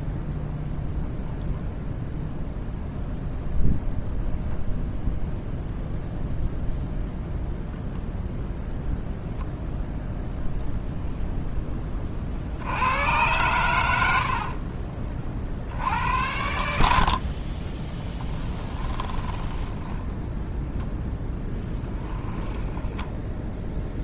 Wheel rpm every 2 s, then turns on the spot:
0, 0, 0, 0, 0, 0, 80, 40, 70, 10, 0, 10.
14-16 18-20 22-24